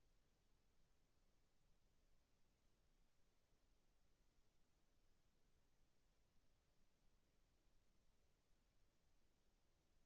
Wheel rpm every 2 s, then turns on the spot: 0, 0, 0, 0, 0.
none